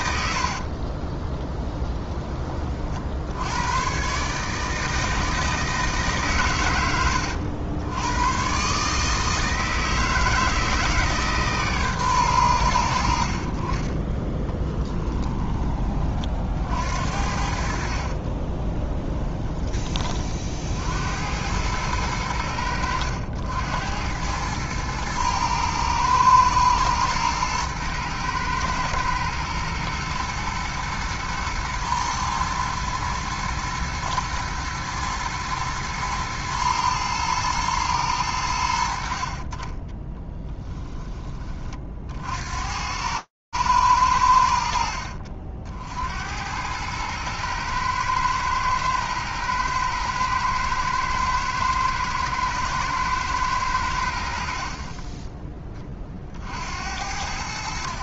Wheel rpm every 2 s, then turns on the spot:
60, 50, 160, 110, 140, 160, 90, 20, 50, 20, 60, 80, 110, 110, 110, 120, 110, 110, 110, 70, 10, 80, 60, 110, 110, 120, 120, 30, 60.
0-2 14-16 18-20 54-56